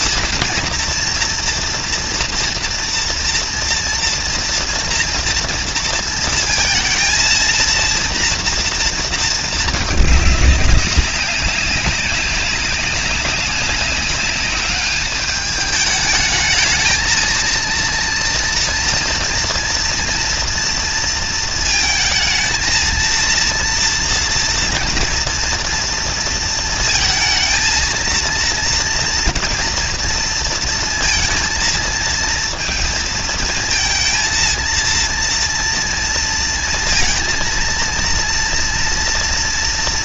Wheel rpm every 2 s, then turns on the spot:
230, 240, 230, 230, 230, 220, 200, 200, 210, 220, 230, 230, 230, 230, 220, 230, 230, 230, 230, 230.
none